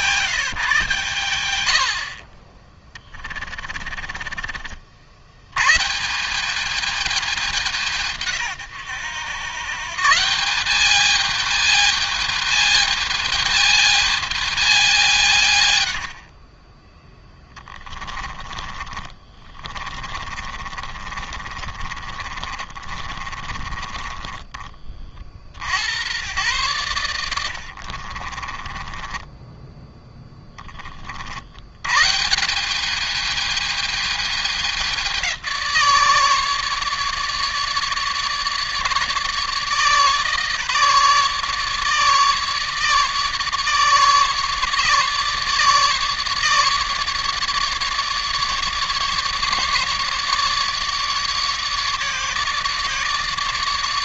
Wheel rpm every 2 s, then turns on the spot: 130, 20, 50, 200, 120, 200, 210, 190, 30, 20, 30, 40, 40, 100, 20, 30, 190, 200, 150, 150, 150, 150, 150, 150, 150, 150, 150.
2-4 18-24 28-30